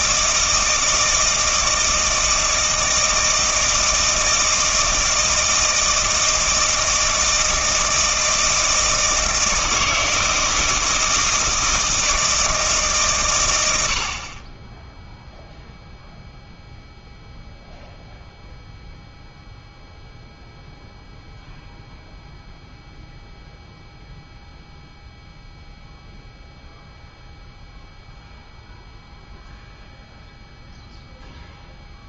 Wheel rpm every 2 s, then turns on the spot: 160, 160, 160, 160, 160, 160, 140, 10, 0, 0, 0, 0, 0, 0, 0, 0.
none